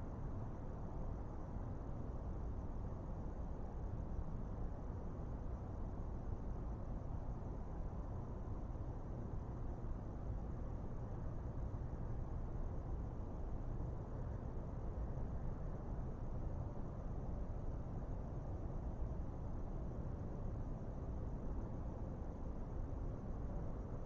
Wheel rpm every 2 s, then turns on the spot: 0, 0, 0, 0, 0, 0, 0, 0, 0, 0, 0, 0.
none